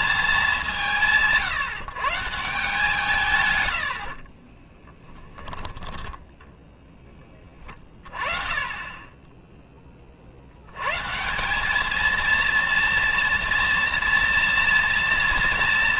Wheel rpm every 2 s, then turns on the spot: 180, 150, 10, 20, 20, 200, 230, 230.
4-6